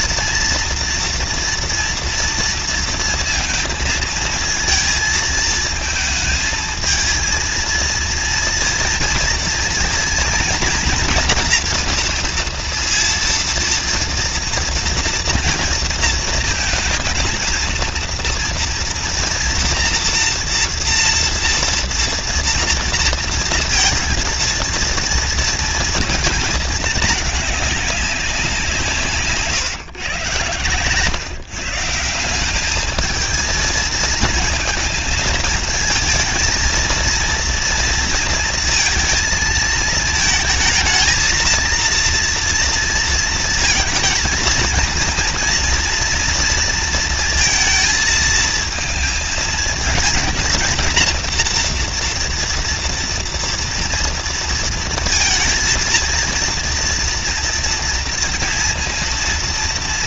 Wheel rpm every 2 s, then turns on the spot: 230, 230, 230, 220, 230, 230, 230, 230, 230, 230, 230, 230, 230, 230, 210, 140, 140, 220, 220, 230, 220, 230, 230, 230, 230, 220, 230, 230, 230, 230.
none